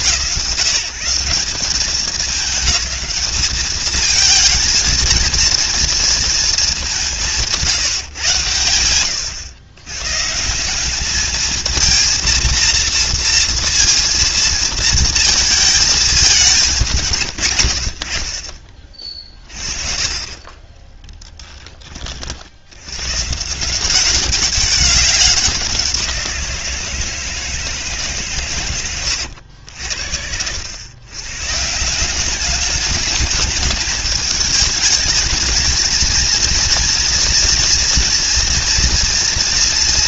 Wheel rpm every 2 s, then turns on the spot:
170, 210, 230, 200, 100, 200, 230, 230, 160, 30, 10, 110, 190, 170, 100, 110, 210, 210, 230, 230.
20-22